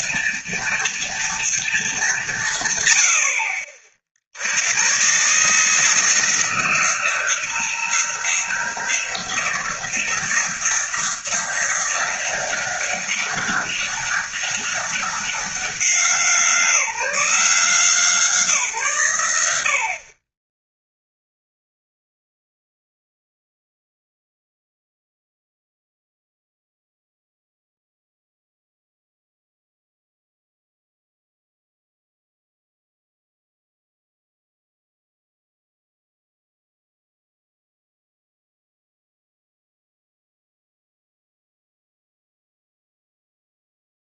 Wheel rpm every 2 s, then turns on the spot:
230, 110, 120, 170, 180, 180, 190, 190, 170, 130, 0, 0, 0, 0, 0, 0, 0, 0, 0, 0, 0, 0.
none